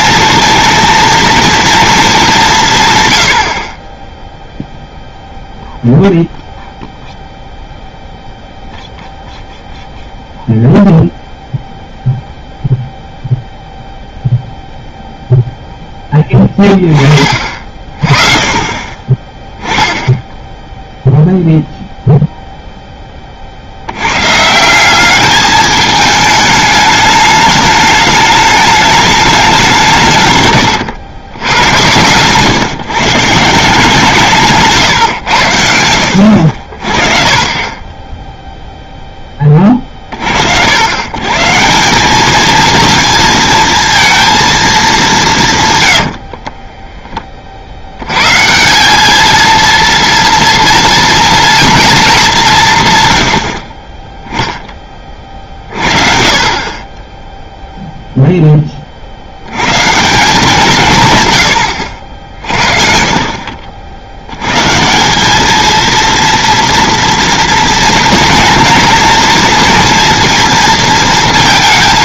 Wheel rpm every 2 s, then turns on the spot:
230, 160, 0, 0, 0, 0, 0, 0, 10, 30, 0, 0, 170, 210, 210, 110, 140, 150, 50, 0, 80, 220, 220, 20, 170, 230, 160, 10, 40, 20, 170, 50, 140, 230, 240, 230.
30-32 46-48